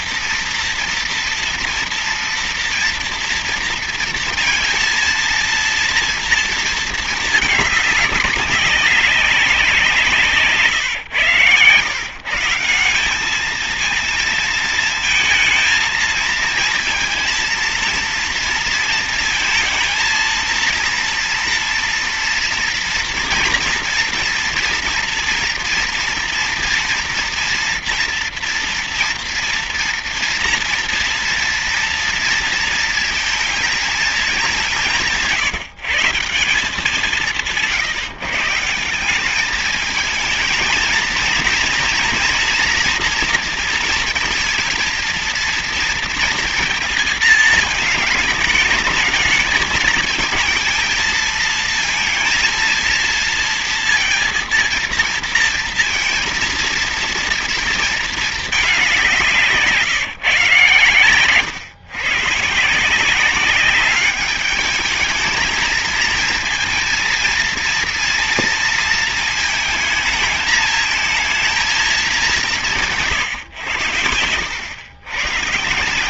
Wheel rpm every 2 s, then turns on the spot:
230, 230, 230, 230, 200, 140, 160, 230, 230, 230, 230, 230, 240, 230, 230, 230, 230, 200, 190, 160, 220, 240, 230, 230, 220, 220, 230, 230, 230, 210, 150, 160, 210, 230, 230, 220, 180, 100.
none